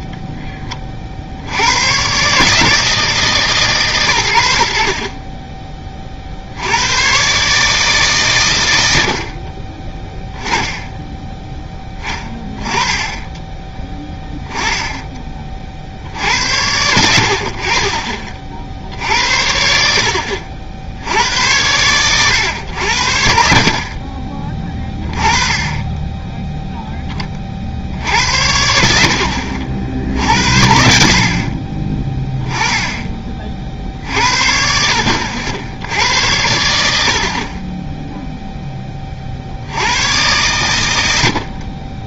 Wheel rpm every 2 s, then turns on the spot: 20, 150, 70, 90, 100, 10, 20, 10, 80, 60, 70, 80, 20, 0, 70, 60, 20, 60, 80, 20, 100.
none